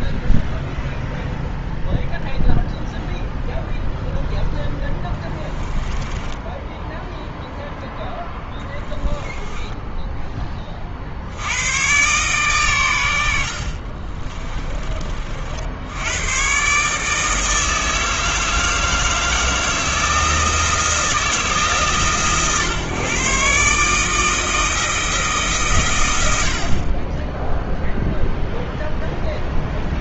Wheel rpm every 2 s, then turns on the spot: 0, 0, 10, 10, 10, 40, 110, 30, 140, 160, 160, 140, 160, 50, 0.
4-6 8-10